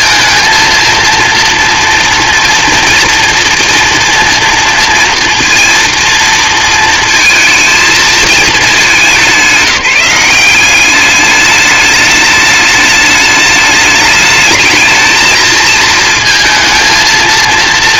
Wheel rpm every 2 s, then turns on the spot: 230, 230, 230, 230, 220, 190, 210, 210, 230.
none